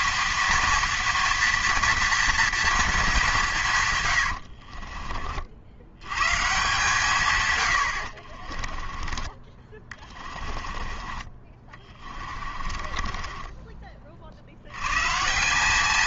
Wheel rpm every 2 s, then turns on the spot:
230, 230, 50, 140, 30, 30, 40, 80.
4-6 8-10 12-14